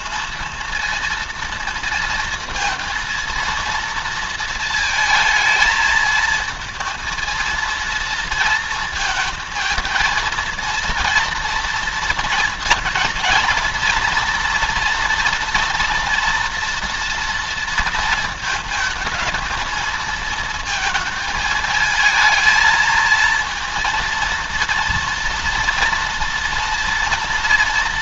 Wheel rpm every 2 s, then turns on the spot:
230, 230, 230, 230, 230, 230, 230, 240, 230, 230, 230, 220, 230, 230.
none